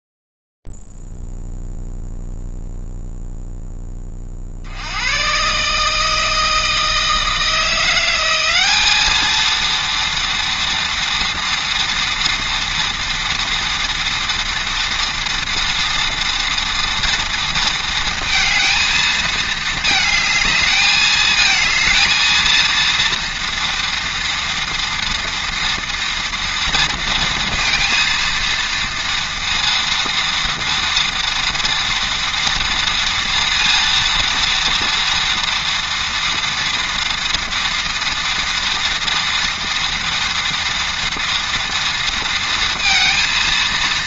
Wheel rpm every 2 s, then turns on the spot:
0, 0, 40, 160, 180, 230, 230, 230, 230, 230, 220, 220, 230, 230, 230, 230, 230, 230, 230, 230, 230, 230.
none